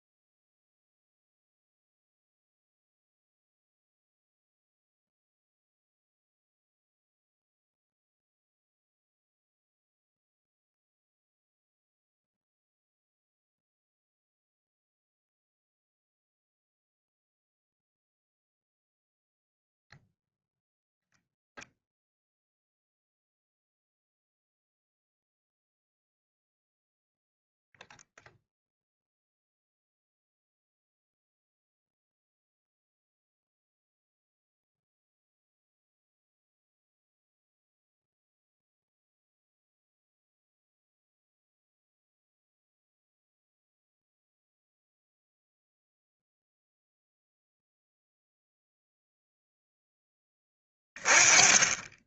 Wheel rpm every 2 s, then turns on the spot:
0, 0, 0, 0, 0, 0, 0, 0, 0, 0, 0, 0, 0, 0, 0, 0, 0, 0, 0, 0, 0, 0, 0, 0, 0, 20.
none